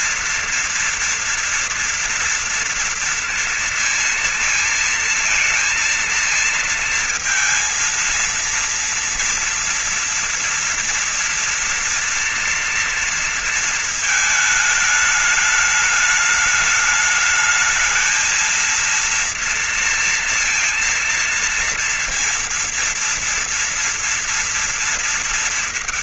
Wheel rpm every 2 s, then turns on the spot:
230, 230, 230, 230, 230, 230, 240, 220, 210, 220, 230, 230, 230.
none